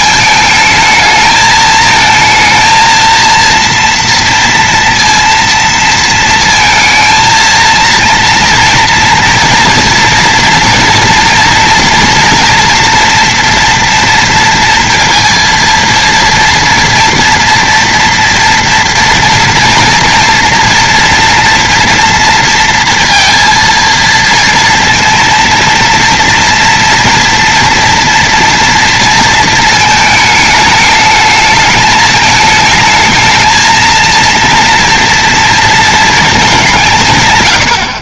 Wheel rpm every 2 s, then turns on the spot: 220, 220, 230, 230, 230, 230, 230, 230, 230, 230, 230, 230, 230, 230, 230, 220, 220, 230, 220.
none